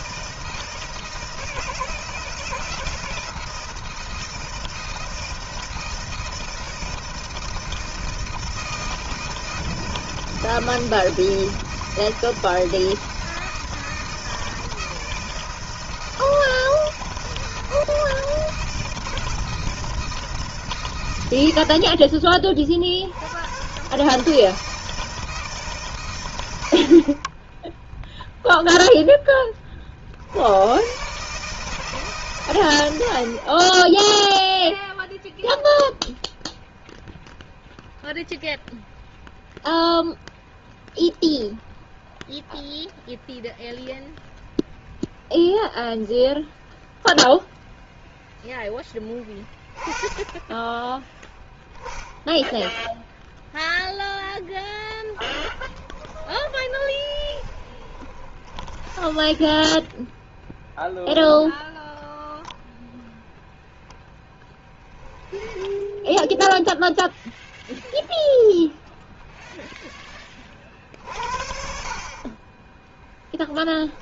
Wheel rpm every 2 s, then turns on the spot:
160, 160, 160, 160, 160, 160, 160, 160, 160, 160, 120, 50, 160, 60, 10, 110, 100, 0, 0, 0, 0, 0, 0, 0, 0, 10, 0, 0, 20, 20, 0, 0, 0, 0, 0, 30, 20.
56-60 72-74